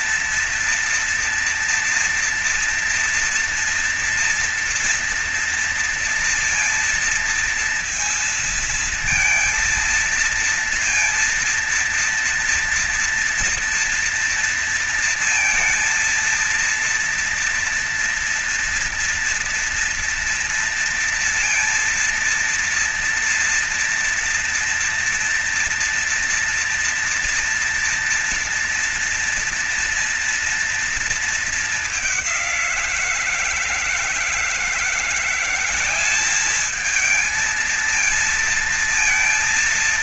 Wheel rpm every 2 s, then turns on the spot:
240, 230, 230, 230, 230, 230, 240, 230, 230, 240, 230, 230, 230, 230, 230, 230, 200, 160, 190, 230.
none